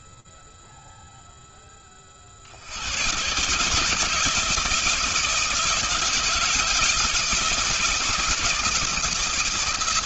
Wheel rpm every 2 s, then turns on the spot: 0, 120, 160, 170, 160.
none